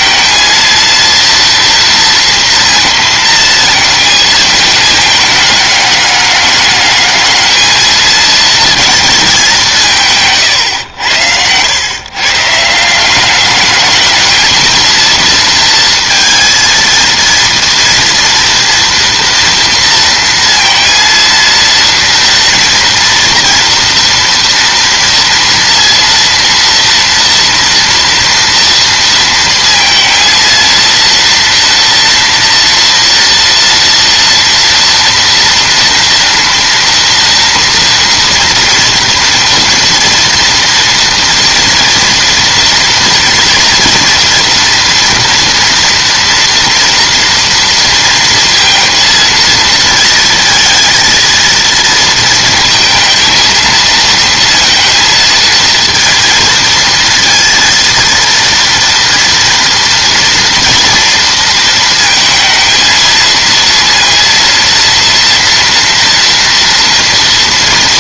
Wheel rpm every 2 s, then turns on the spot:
230, 230, 210, 210, 210, 100, 160, 220, 230, 230, 230, 230, 230, 230, 230, 230, 240, 230, 230, 230, 230, 240, 230, 230, 230, 230, 220, 230, 230, 230, 240, 220, 230, 230.
none